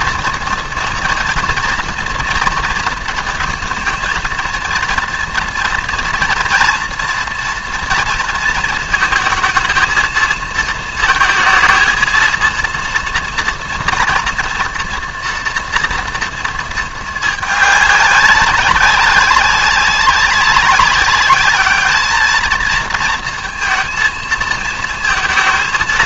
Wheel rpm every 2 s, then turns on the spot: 230, 220, 230, 230, 230, 220, 230, 240, 230, 200, 200, 220, 220.
none